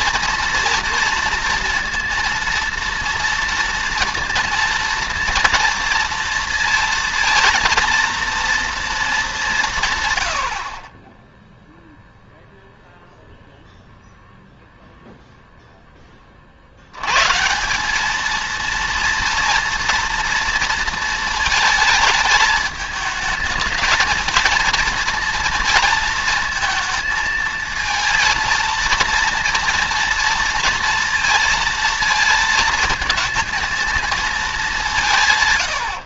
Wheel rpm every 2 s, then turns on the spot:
230, 230, 230, 230, 230, 70, 0, 0, 40, 220, 230, 220, 230, 230, 230, 230, 220, 210.
none